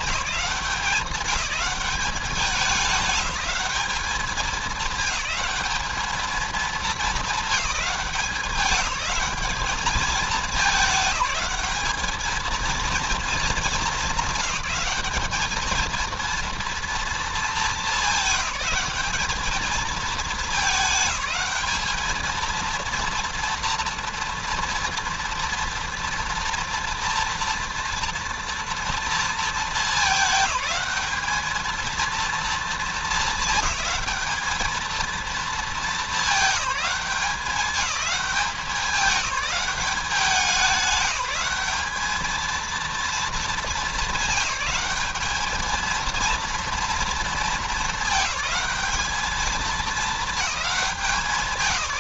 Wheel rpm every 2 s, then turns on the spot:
190, 200, 210, 220, 200, 210, 220, 210, 230, 200, 220, 220, 230, 230, 230, 210, 230, 220, 190, 190, 180, 220, 200, 230, 220, 220.
none